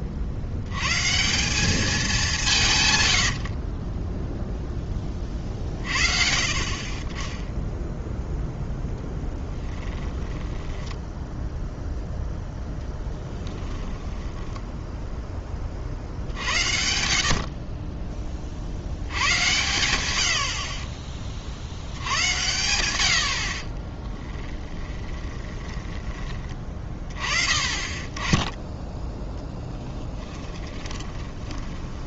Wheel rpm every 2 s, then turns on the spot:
80, 170, 0, 50, 0, 10, 0, 10, 70, 50, 50, 110, 10, 20, 10, 20.
10-12 14-16 24-26 30-32